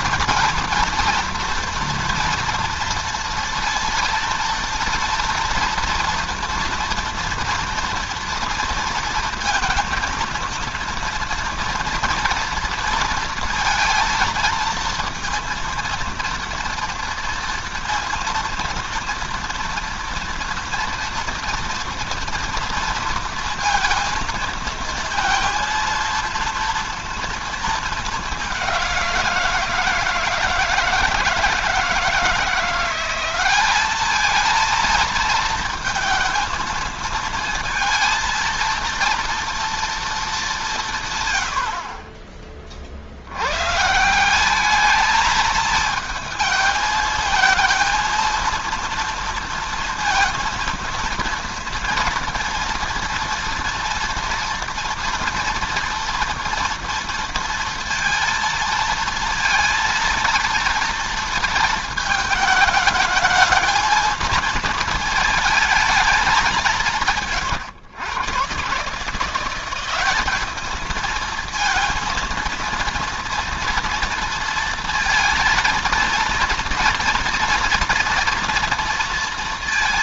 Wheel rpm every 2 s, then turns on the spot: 230, 230, 230, 230, 230, 230, 230, 230, 230, 230, 230, 230, 230, 230, 180, 160, 180, 220, 230, 230, 160, 50, 210, 220, 230, 230, 230, 240, 230, 230, 230, 220, 220, 170, 150, 220, 230, 230, 230, 230.
none